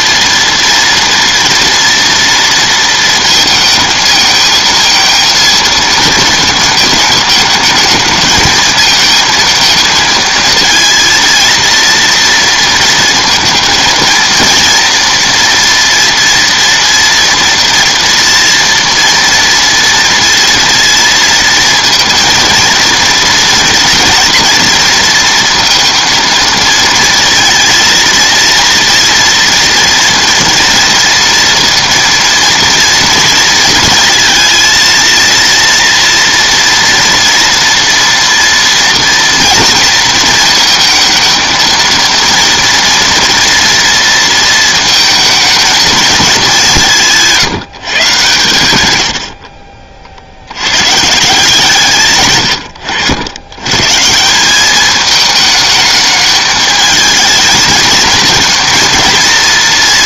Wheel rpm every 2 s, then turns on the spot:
230, 230, 230, 220, 220, 230, 230, 230, 230, 230, 230, 230, 230, 220, 230, 230, 230, 230, 230, 230, 230, 230, 230, 190, 110, 90, 100, 190, 220, 230.
none